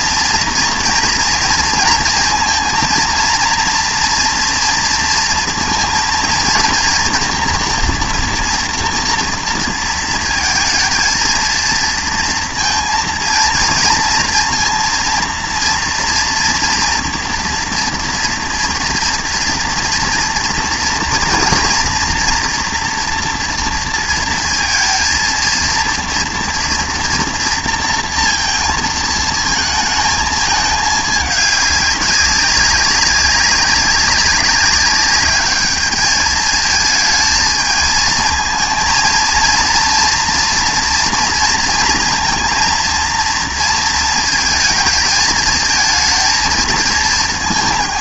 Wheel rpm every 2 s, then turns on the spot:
230, 230, 230, 230, 240, 230, 230, 230, 230, 240, 240, 230, 230, 230, 230, 220, 190, 190, 220, 230, 240, 230, 220, 220.
none